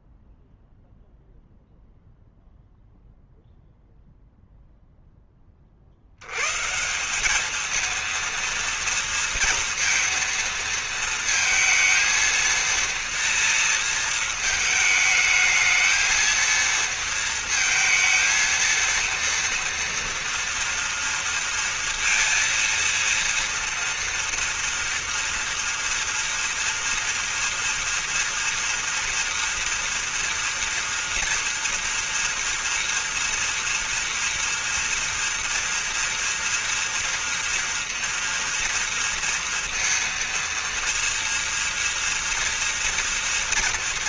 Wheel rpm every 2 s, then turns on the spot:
0, 0, 10, 180, 240, 230, 230, 220, 230, 230, 230, 230, 230, 230, 230, 230, 230, 230, 230, 230, 230, 240.
none